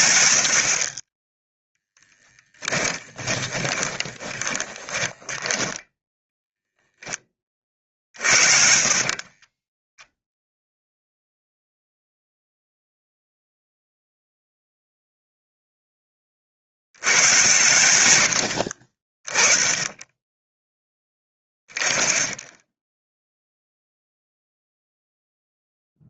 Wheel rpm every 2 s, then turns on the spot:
30, 20, 20, 10, 50, 0, 0, 0, 90, 40, 10, 10, 0.
2-6 8-10